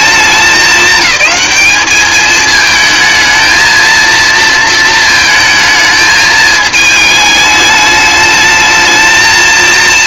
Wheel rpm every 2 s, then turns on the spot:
200, 220, 230, 220, 220.
none